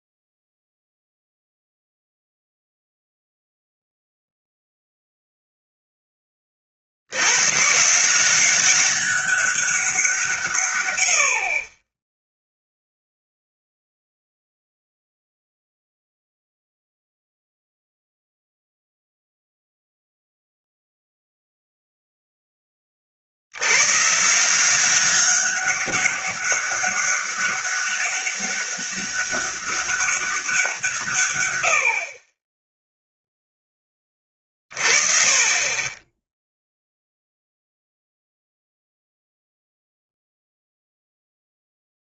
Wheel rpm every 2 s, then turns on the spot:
0, 0, 0, 60, 190, 130, 0, 0, 0, 0, 0, 30, 180, 200, 200, 170, 10, 30, 0, 0, 0.
none